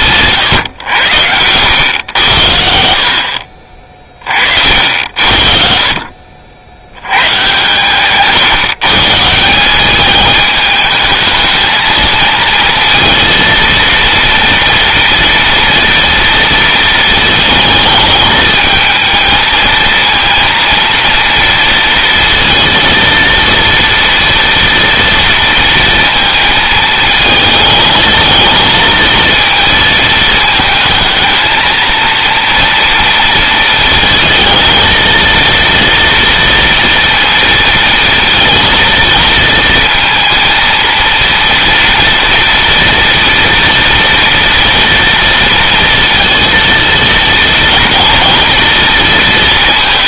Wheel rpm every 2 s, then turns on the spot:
100, 60, 70, 100, 140, 220, 230, 230, 230, 220, 230, 230, 230, 220, 230, 220, 230, 230, 230, 230, 230, 240, 230, 230, 230.
none